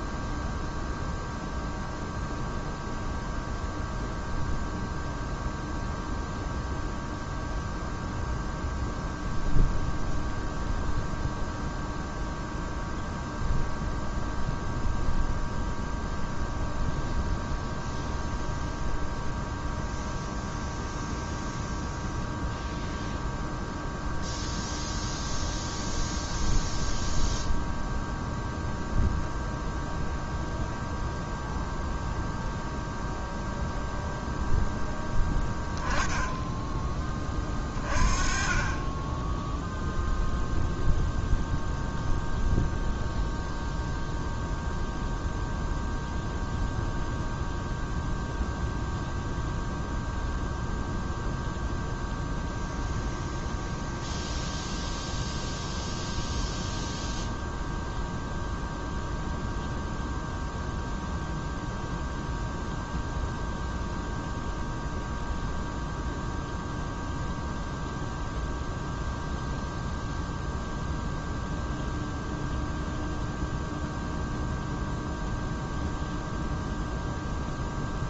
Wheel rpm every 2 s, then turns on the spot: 0, 0, 0, 0, 0, 0, 0, 0, 0, 0, 0, 0, 0, 0, 0, 0, 0, 0, 10, 30, 0, 0, 0, 0, 0, 0, 0, 0, 0, 0, 0, 0, 0, 0, 0, 0, 0, 0, 0.
none